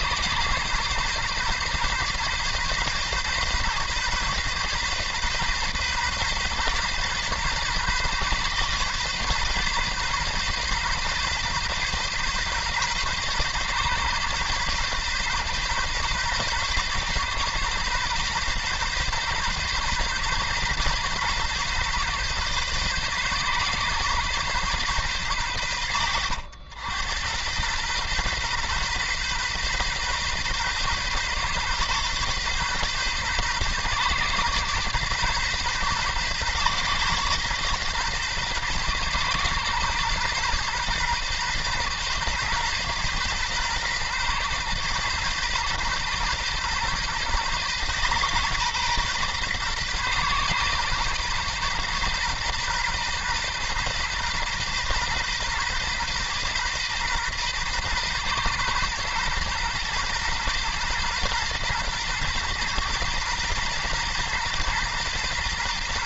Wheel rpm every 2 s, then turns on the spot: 130, 130, 130, 130, 130, 130, 130, 130, 130, 130, 130, 130, 130, 90, 130, 130, 130, 130, 130, 130, 130, 120, 130, 130, 120, 130, 130, 130, 130, 120, 120, 120, 120.
none